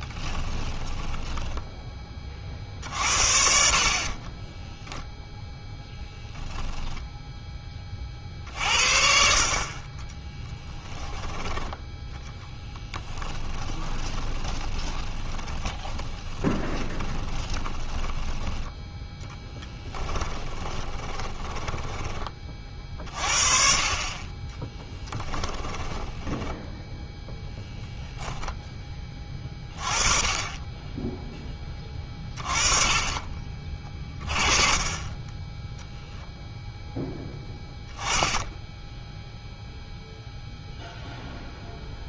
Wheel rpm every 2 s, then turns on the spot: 10, 50, 10, 0, 50, 10, 10, 20, 20, 10, 20, 40, 20, 0, 10, 20, 30, 20, 0, 0, 0.
0-2 4-6 12-18 20-22 24-26